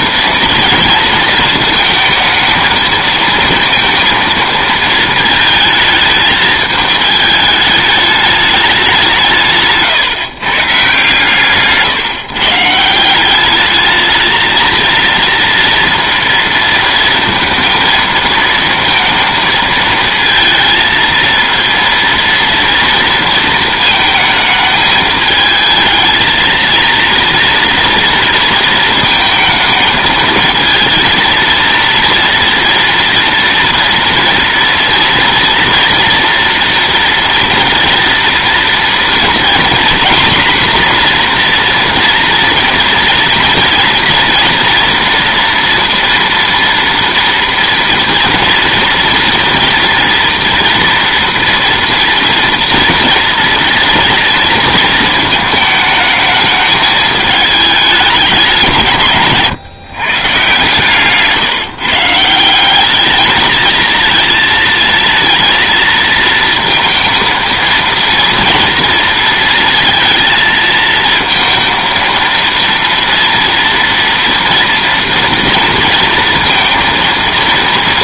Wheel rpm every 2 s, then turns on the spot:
230, 230, 220, 210, 200, 150, 160, 230, 230, 230, 220, 230, 220, 230, 230, 220, 230, 230, 230, 230, 240, 230, 230, 230, 240, 230, 230, 220, 210, 150, 140, 200, 230, 230, 230, 230, 230, 230, 230.
none